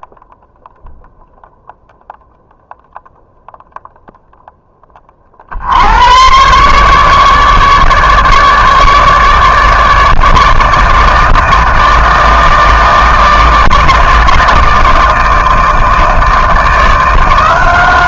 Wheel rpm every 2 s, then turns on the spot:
0, 0, 10, 130, 150, 160, 160, 160, 160.
none